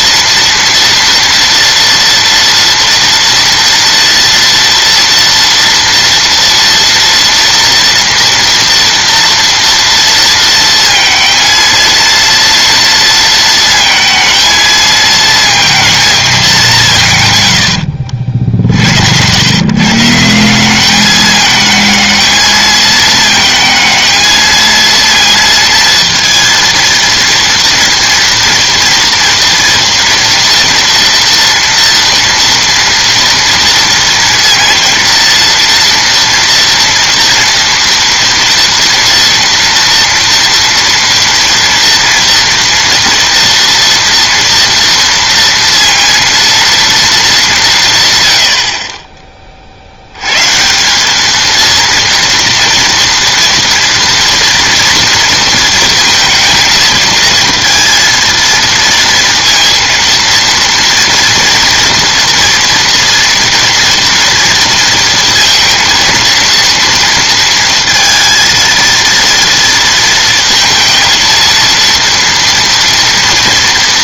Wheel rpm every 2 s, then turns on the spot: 230, 230, 230, 230, 240, 230, 230, 220, 200, 60, 180, 220, 230, 230, 230, 240, 230, 230, 230, 230, 230, 240, 230, 230, 90, 140, 230, 230, 220, 230, 230, 230, 230, 230, 230, 230, 230.
none